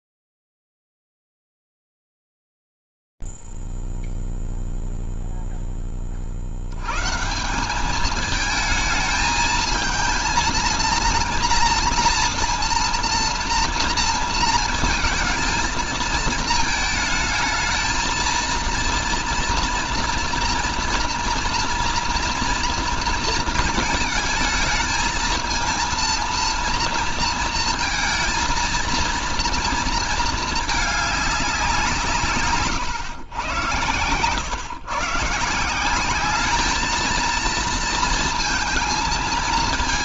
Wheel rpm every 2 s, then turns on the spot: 0, 0, 0, 20, 200, 220, 230, 230, 230, 220, 230, 230, 220, 230, 230, 220, 150, 120, 200, 230.
none